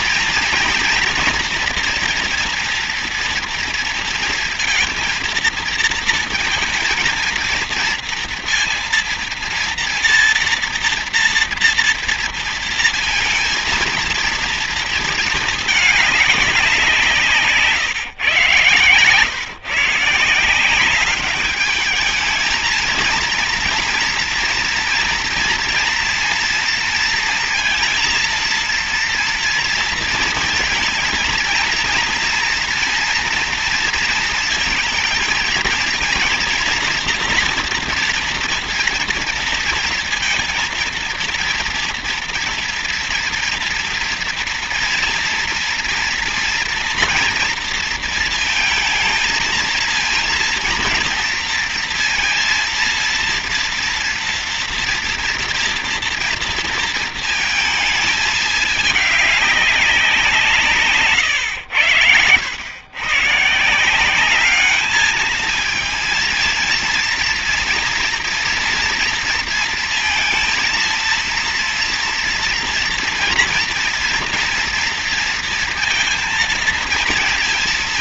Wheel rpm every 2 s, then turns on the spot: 230, 230, 230, 220, 230, 240, 230, 220, 170, 120, 200, 230, 230, 230, 230, 230, 240, 220, 230, 230, 230, 230, 230, 230, 220, 230, 230, 240, 230, 210, 150, 120, 210, 230, 230, 230, 240, 230, 230.
none